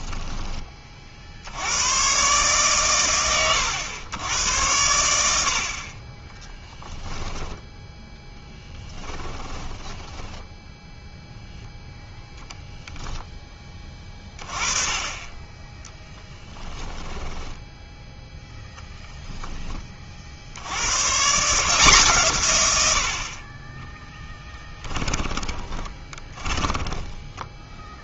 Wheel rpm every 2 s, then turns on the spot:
30, 130, 90, 0, 10, 0, 10, 20, 10, 0, 90, 90, 10, 10.
8-10 16-18 24-28